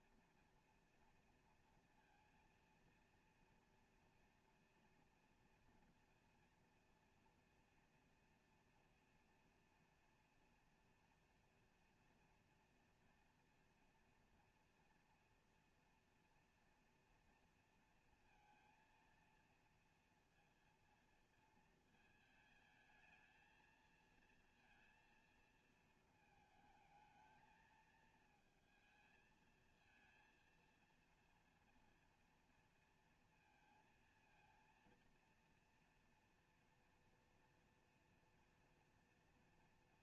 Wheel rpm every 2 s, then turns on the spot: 230, 230, 230, 230, 230, 230, 240, 240, 230, 230, 230, 220, 230, 220, 220, 230, 230, 230, 230, 240.
none